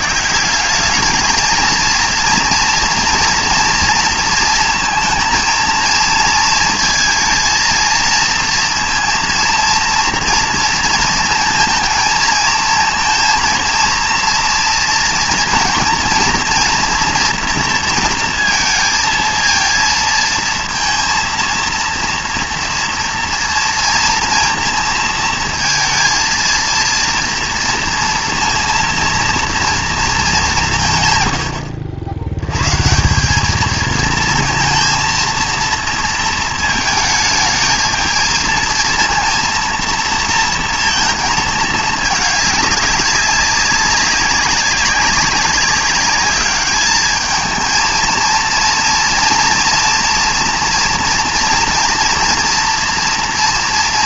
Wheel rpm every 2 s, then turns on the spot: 200, 230, 230, 230, 230, 230, 230, 230, 230, 230, 220, 230, 230, 230, 230, 160, 150, 230, 220, 230, 230, 200, 200, 210, 230, 230, 230.
none